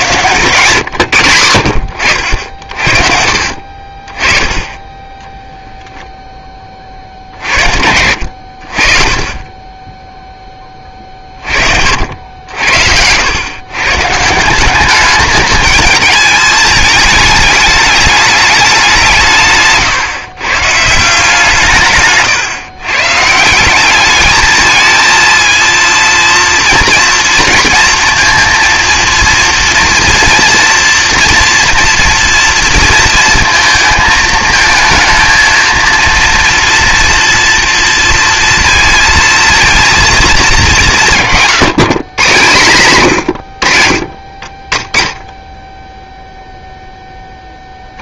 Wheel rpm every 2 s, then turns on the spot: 110, 50, 20, 30, 40, 20, 70, 180, 220, 190, 150, 130, 220, 230, 230, 230, 230, 220, 230, 230, 170, 150, 20, 0.
none